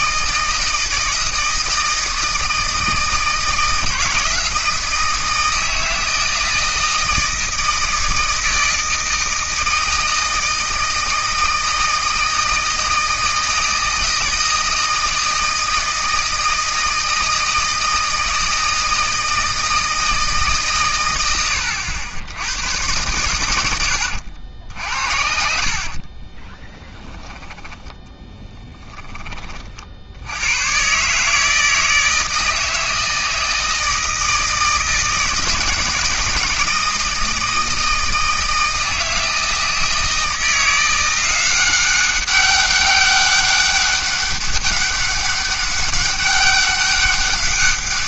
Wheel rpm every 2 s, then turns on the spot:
160, 160, 170, 160, 160, 160, 160, 160, 160, 160, 140, 90, 70, 20, 10, 110, 160, 160, 160, 160, 170, 200, 200, 200.
26-28